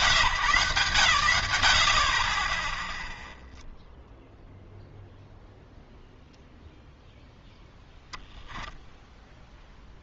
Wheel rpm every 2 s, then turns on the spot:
150, 10, 0, 0, 10.
none